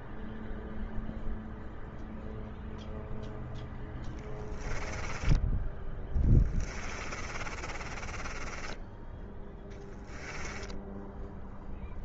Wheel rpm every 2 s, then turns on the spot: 0, 0, 10, 30, 10, 10.
4-10